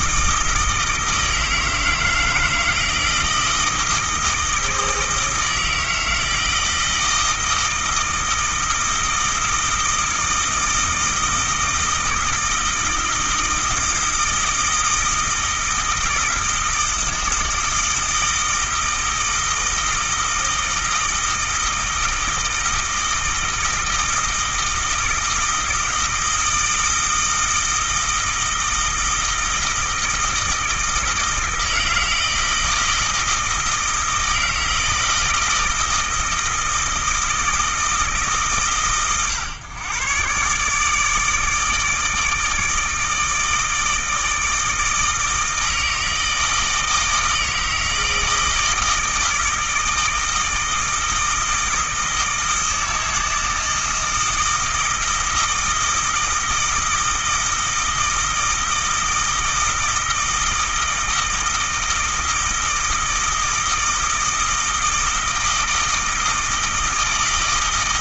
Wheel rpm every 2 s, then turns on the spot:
160, 160, 160, 160, 160, 160, 160, 160, 160, 160, 160, 160, 160, 160, 160, 160, 160, 160, 160, 140, 150, 150, 160, 160, 160, 160, 160, 160, 160, 160, 160, 160, 160, 160.
none